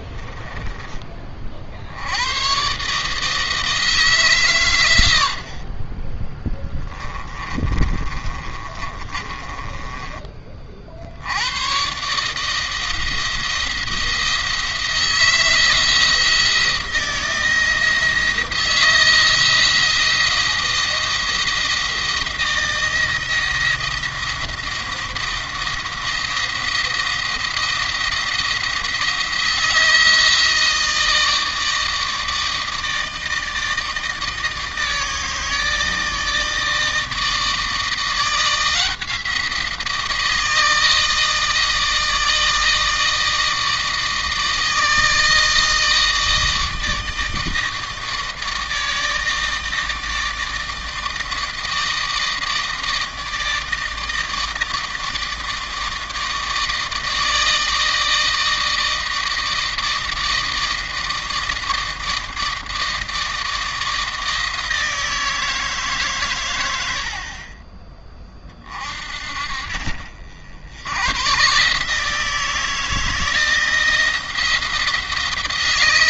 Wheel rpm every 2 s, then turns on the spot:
20, 130, 120, 20, 30, 50, 160, 160, 160, 160, 170, 170, 170, 170, 170, 160, 160, 160, 160, 170, 160, 160, 160, 160, 160, 160, 160, 160, 160, 160, 160, 160, 160, 100, 40, 80, 160, 170.
6-10